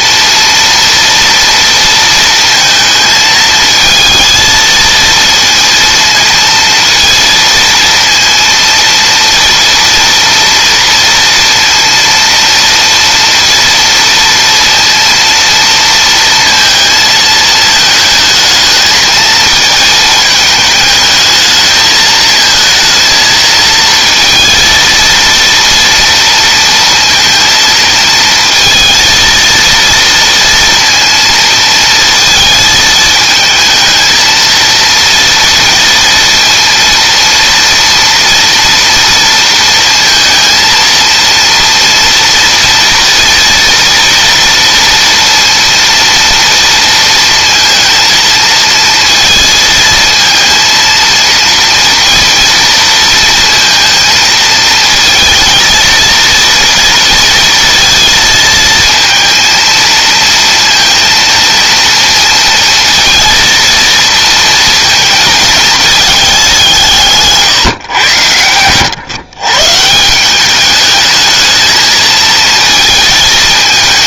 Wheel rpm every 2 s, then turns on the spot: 230, 220, 230, 230, 230, 230, 230, 230, 230, 220, 210, 230, 230, 230, 230, 230, 220, 230, 230, 230, 230, 230, 230, 230, 230, 230, 230, 220, 230, 230, 230, 230, 220, 160, 120, 210, 230.
none